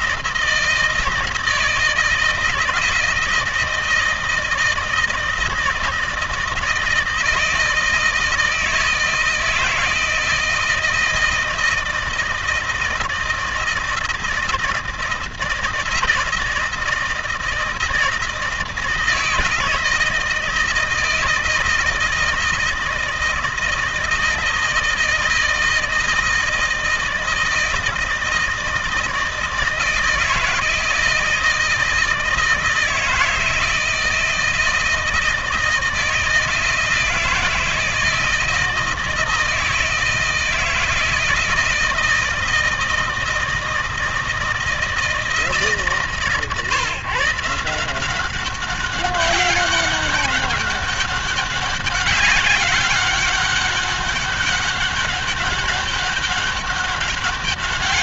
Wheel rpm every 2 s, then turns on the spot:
160, 160, 160, 160, 160, 160, 160, 160, 160, 160, 160, 160, 160, 160, 160, 160, 160, 160, 160, 160, 160, 160, 160, 140, 190, 200, 190, 200, 200.
none